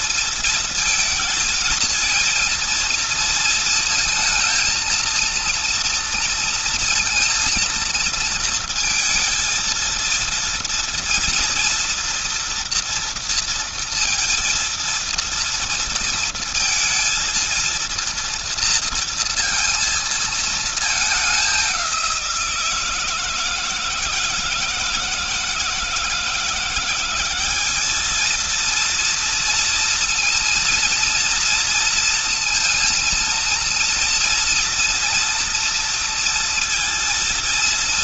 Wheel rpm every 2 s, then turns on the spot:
220, 230, 230, 230, 230, 230, 230, 230, 230, 230, 210, 160, 160, 180, 230, 230, 230, 230, 230.
none